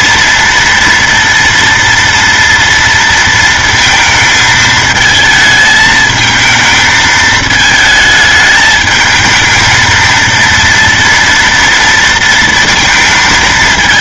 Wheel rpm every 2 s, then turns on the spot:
240, 230, 220, 220, 220, 230, 230.
none